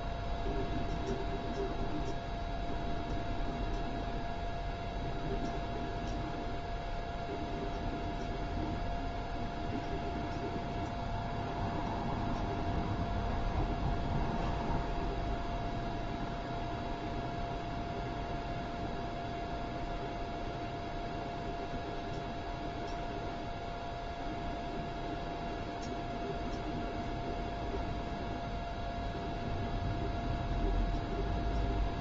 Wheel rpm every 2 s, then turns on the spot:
0, 0, 0, 0, 0, 0, 0, 0, 0, 0, 0, 0, 0, 0, 0, 0.
none